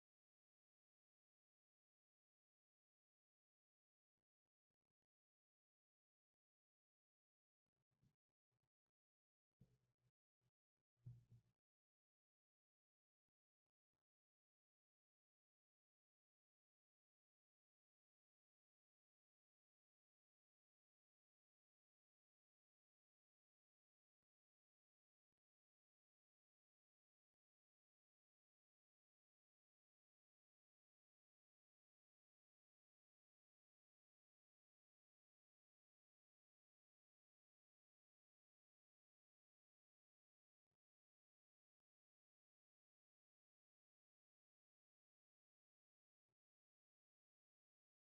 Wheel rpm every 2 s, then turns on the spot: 0, 0, 0, 0, 0, 0, 0, 0, 0, 0, 0, 0, 0, 0, 0, 0, 0, 0, 0, 0, 0, 0, 0, 0.
none